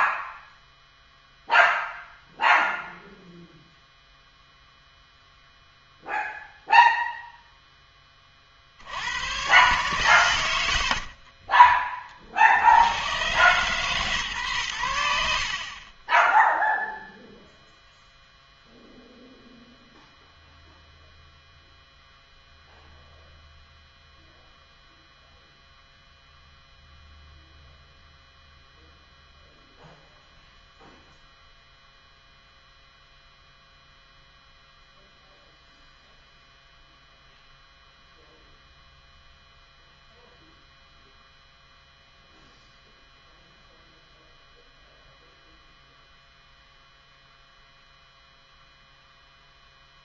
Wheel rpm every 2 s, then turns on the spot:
0, 0, 0, 0, 70, 70, 90, 90, 0, 0, 0, 0, 0, 0, 0, 0, 0, 0, 0, 0, 0, 0, 0, 0, 0.
none